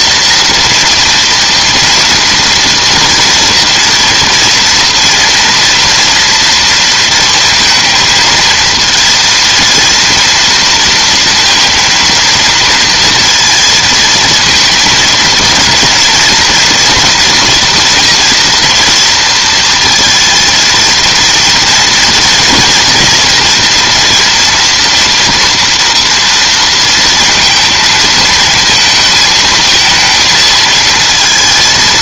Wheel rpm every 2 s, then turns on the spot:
240, 240, 230, 230, 230, 230, 230, 230, 230, 230, 230, 230, 230, 230, 230, 230.
none